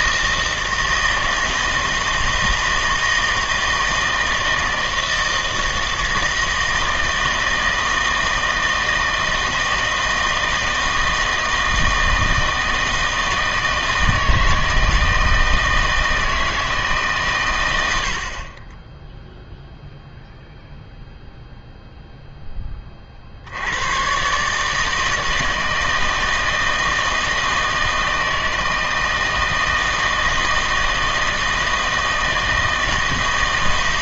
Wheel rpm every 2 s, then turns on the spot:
160, 160, 160, 160, 160, 160, 160, 160, 160, 30, 0, 20, 150, 160, 160, 160, 160.
none